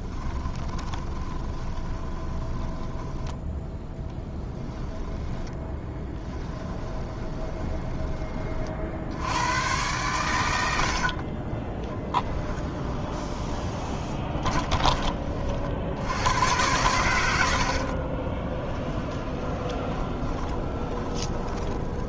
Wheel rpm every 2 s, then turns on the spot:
20, 10, 10, 10, 50, 80, 10, 20, 110, 20, 30.
0-2 4-8 10-16 18-22